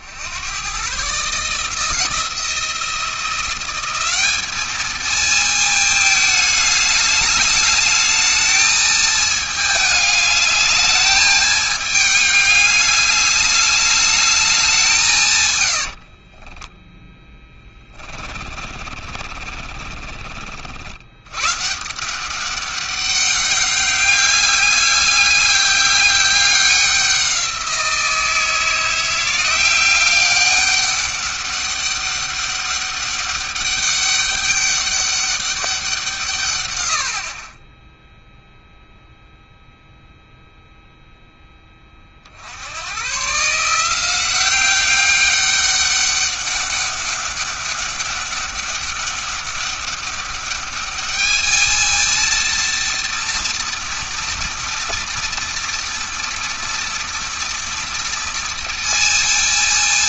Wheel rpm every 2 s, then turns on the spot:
100, 170, 220, 210, 220, 210, 210, 170, 10, 40, 60, 190, 200, 190, 170, 200, 200, 200, 120, 0, 0, 90, 190, 200, 200, 210, 230, 240, 240, 230.
18-20